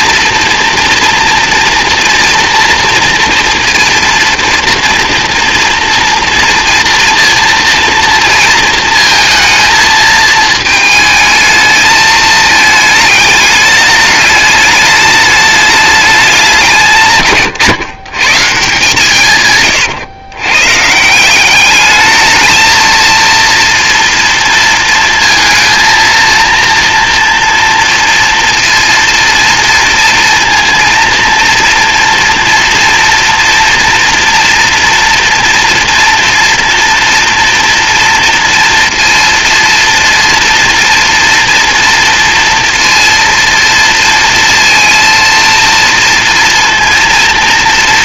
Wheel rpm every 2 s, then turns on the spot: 230, 230, 230, 230, 230, 220, 220, 210, 170, 160, 140, 220, 230, 230, 230, 230, 230, 230, 230, 230, 230, 230, 230, 230.
none